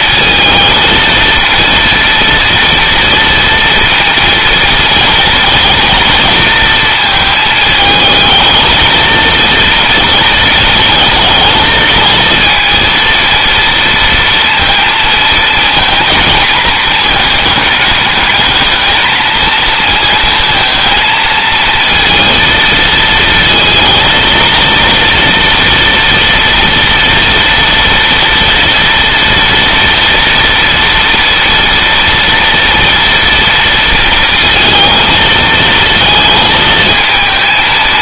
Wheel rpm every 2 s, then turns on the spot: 230, 230, 230, 220, 230, 220, 230, 230, 220, 220, 230, 230, 230, 230, 230, 230, 230, 230, 220.
none